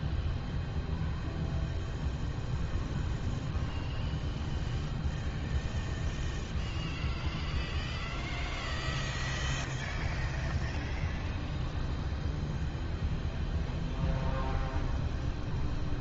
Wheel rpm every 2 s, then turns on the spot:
0, 0, 0, 0, 0, 0, 0, 0.
none